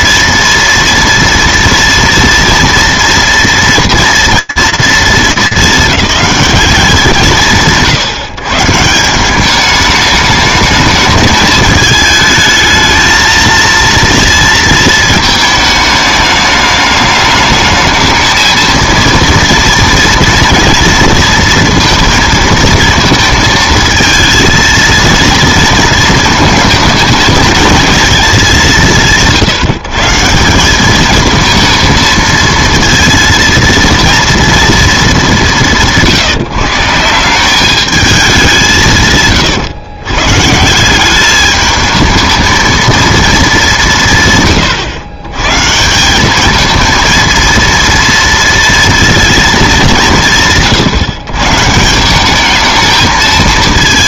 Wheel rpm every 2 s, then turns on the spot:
230, 230, 230, 210, 160, 220, 220, 220, 210, 220, 230, 230, 230, 220, 180, 190, 230, 230, 150, 170, 160, 230, 130, 220, 230, 150, 210.
none